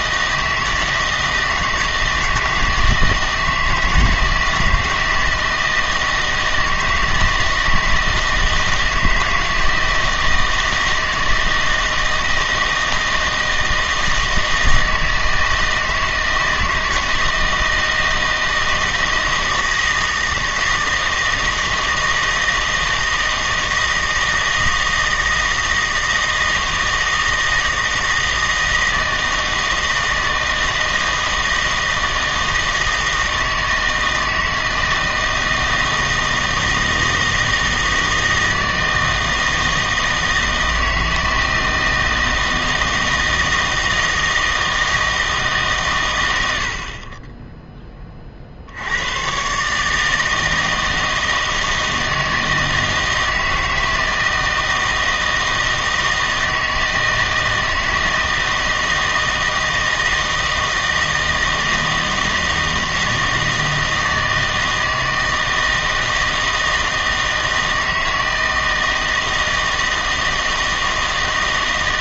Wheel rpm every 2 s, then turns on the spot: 160, 160, 160, 160, 160, 160, 160, 160, 160, 160, 160, 160, 160, 160, 160, 160, 160, 160, 160, 160, 160, 160, 160, 50, 80, 160, 160, 160, 160, 160, 160, 160, 160, 160, 160, 160.
none